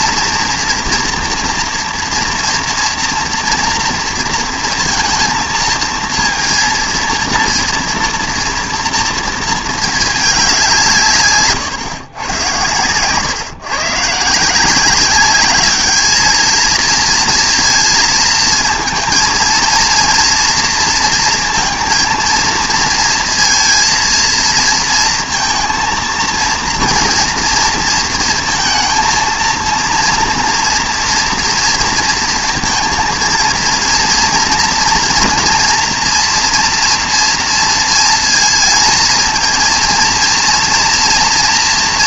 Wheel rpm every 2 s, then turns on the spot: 230, 230, 230, 230, 230, 170, 120, 180, 220, 230, 230, 230, 230, 230, 230, 230, 230, 230, 240, 230, 230.
none